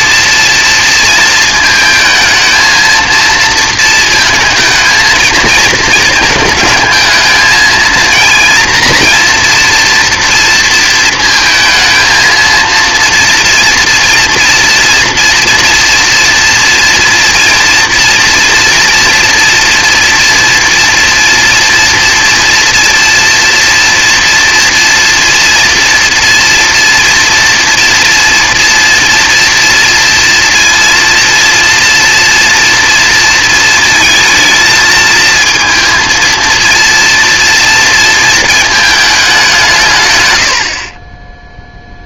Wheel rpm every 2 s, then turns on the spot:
230, 230, 230, 220, 230, 230, 230, 240, 230, 230, 230, 230, 230, 230, 230, 230, 230, 230, 230, 220, 80.
none